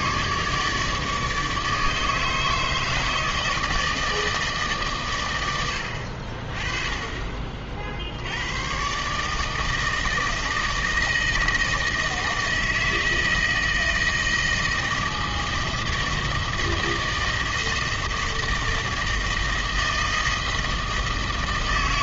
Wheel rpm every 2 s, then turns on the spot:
150, 150, 140, 30, 110, 160, 160, 160, 160, 160, 160.
none